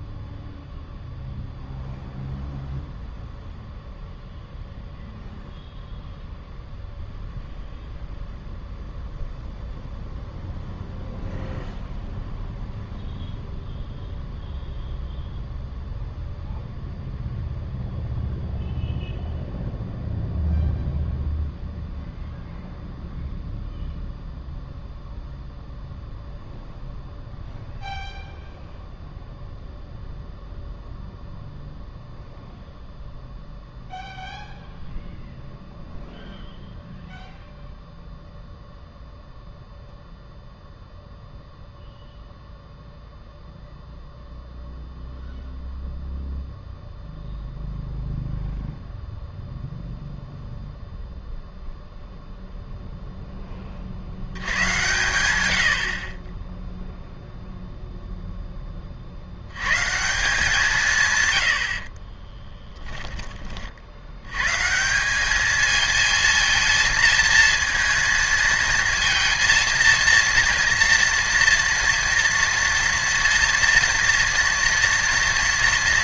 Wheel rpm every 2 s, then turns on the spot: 0, 0, 0, 0, 0, 0, 0, 0, 0, 0, 0, 0, 0, 0, 0, 0, 0, 0, 0, 0, 0, 0, 0, 0, 0, 0, 0, 110, 10, 20, 180, 10, 140, 230, 230, 230, 230, 230.
62-64